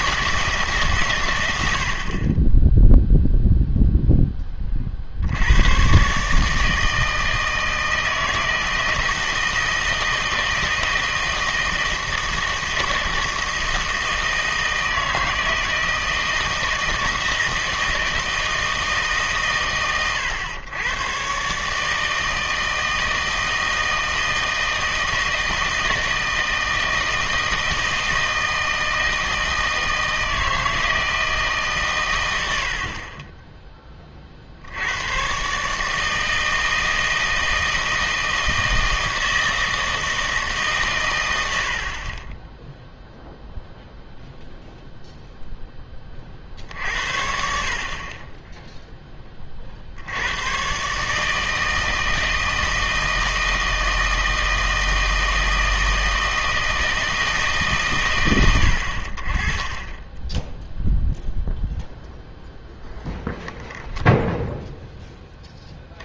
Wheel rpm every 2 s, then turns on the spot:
150, 10, 30, 160, 160, 160, 160, 160, 160, 160, 100, 160, 160, 160, 160, 160, 70, 60, 160, 160, 150, 10, 0, 50, 10, 120, 160, 160, 160, 90, 0, 0, 0.
none